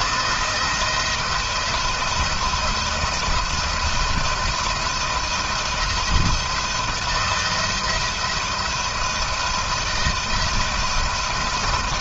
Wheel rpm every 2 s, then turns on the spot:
170, 170, 170, 170, 170, 170.
none